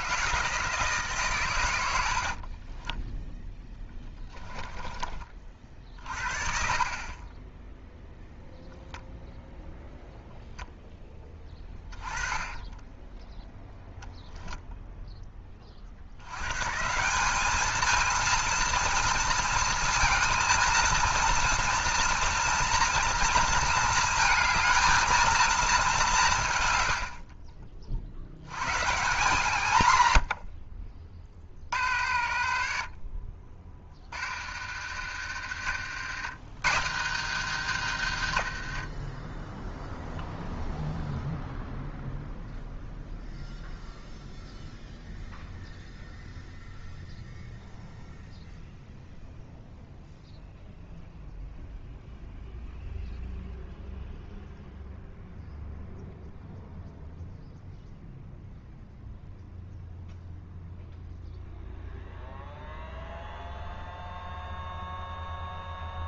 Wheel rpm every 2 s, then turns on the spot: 160, 40, 10, 40, 0, 0, 10, 10, 130, 230, 230, 240, 220, 130, 120, 60, 50, 70, 110, 70, 0, 0, 0, 0, 0, 0, 0, 0, 0, 0, 0, 0, 0.
2-8 12-14 32-36